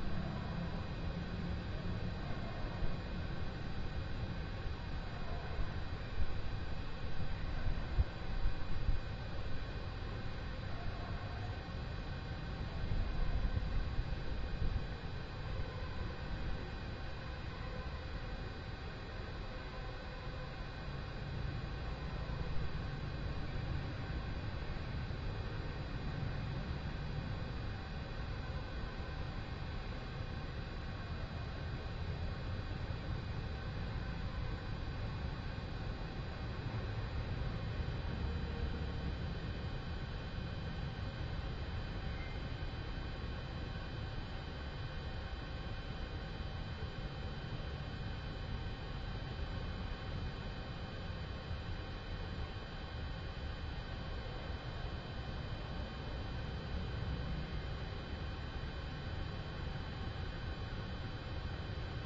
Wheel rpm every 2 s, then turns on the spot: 0, 0, 0, 0, 0, 0, 0, 0, 0, 0, 0, 0, 0, 0, 0, 0, 0, 0, 0, 0, 0, 0, 0, 0, 0, 0, 0, 0, 0, 0, 0.
none